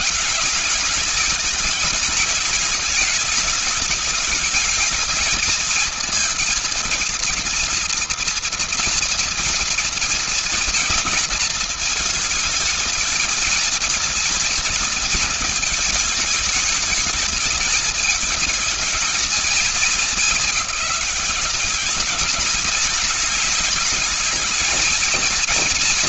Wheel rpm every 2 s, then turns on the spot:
210, 210, 210, 220, 230, 220, 220, 230, 220, 220, 200, 210, 230.
none